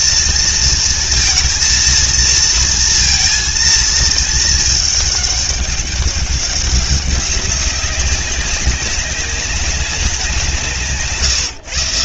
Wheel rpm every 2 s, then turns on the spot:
230, 230, 210, 190, 190, 160.
none